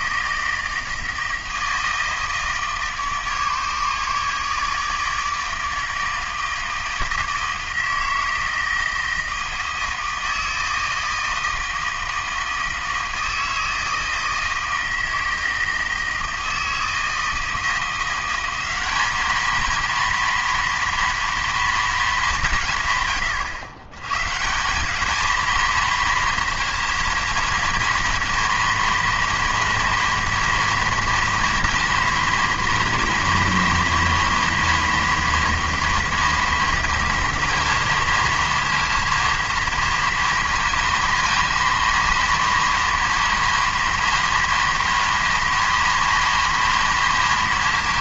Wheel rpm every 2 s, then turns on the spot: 160, 150, 150, 160, 160, 160, 160, 160, 160, 200, 230, 150, 180, 230, 230, 230, 230, 230, 230, 230, 230, 230, 230, 230.
none